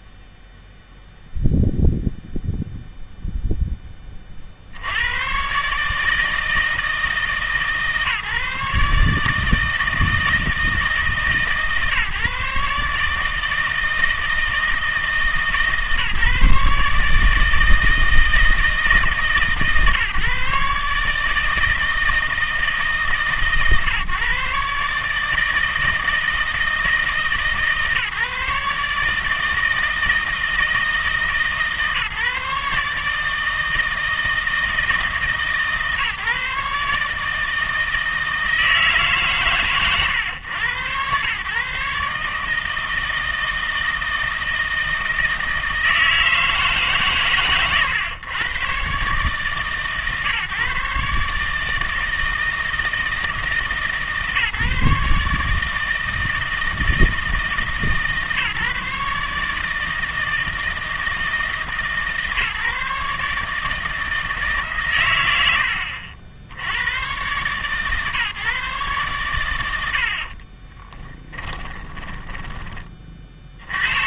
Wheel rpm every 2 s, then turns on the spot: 0, 0, 60, 160, 140, 160, 140, 160, 150, 160, 140, 160, 140, 160, 150, 160, 150, 160, 150, 160, 110, 160, 160, 150, 120, 140, 160, 150, 160, 150, 160, 150, 130, 90, 140, 30, 20.
70-74